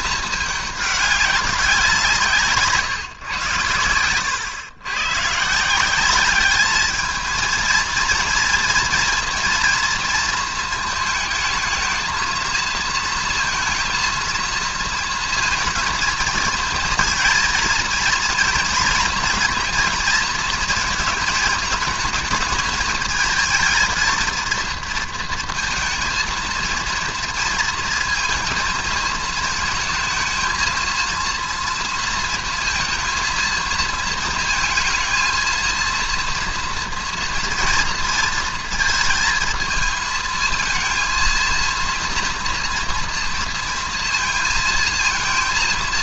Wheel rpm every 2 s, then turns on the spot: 210, 150, 110, 210, 230, 220, 230, 230, 220, 230, 230, 220, 230, 230, 220, 220, 230, 230, 230, 220, 220, 230, 230.
none